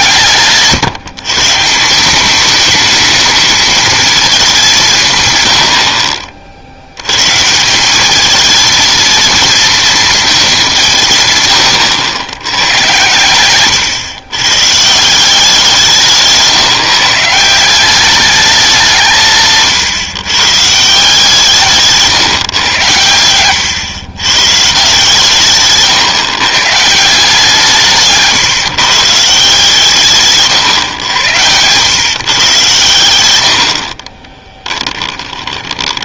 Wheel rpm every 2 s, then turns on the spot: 140, 220, 180, 80, 220, 170, 110, 150, 160, 180, 150, 110, 160, 160, 140, 120, 120, 20.
34-36